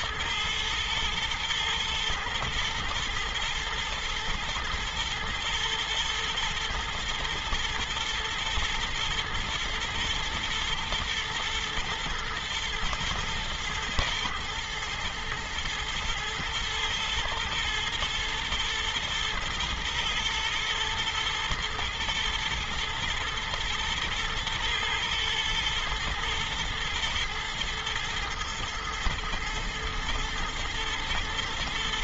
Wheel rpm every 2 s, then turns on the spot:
110, 110, 120, 120, 120, 120, 110, 120, 110, 110, 110, 110, 110, 120, 110, 110.
none